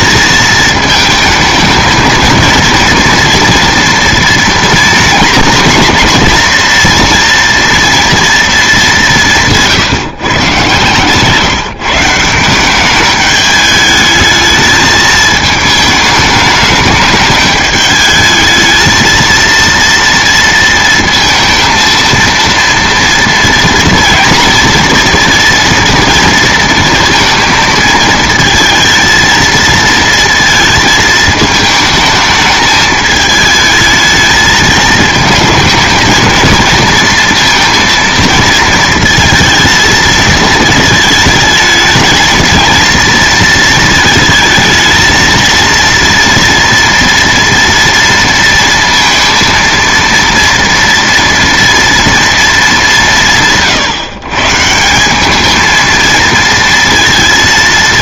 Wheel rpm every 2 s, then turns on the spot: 220, 230, 230, 230, 210, 140, 200, 220, 210, 220, 230, 230, 230, 230, 220, 220, 210, 220, 230, 230, 220, 230, 220, 230, 230, 230, 200, 160, 230.
none